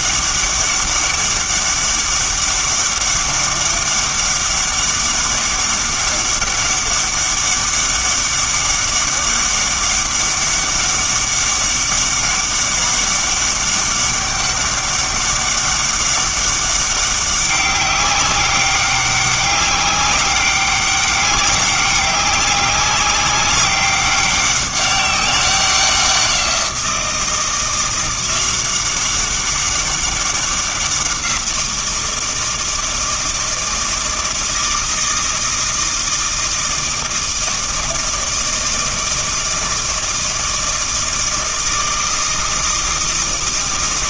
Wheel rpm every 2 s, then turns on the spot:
200, 200, 200, 200, 200, 200, 200, 200, 200, 200, 200, 190, 200, 170, 190, 190, 160, 160, 160, 160, 160, 160.
none